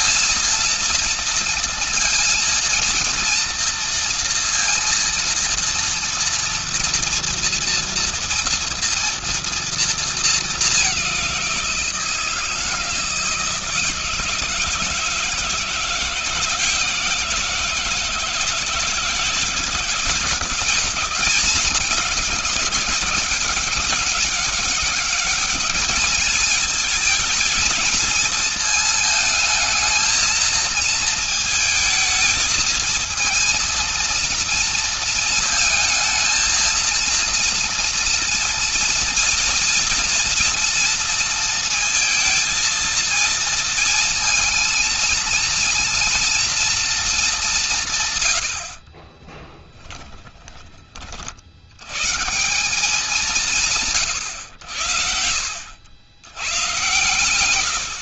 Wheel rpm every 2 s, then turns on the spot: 230, 230, 240, 230, 230, 190, 160, 160, 170, 170, 170, 200, 200, 220, 220, 220, 230, 230, 230, 230, 230, 230, 230, 220, 40, 30, 170, 70, 120.
48-50 54-56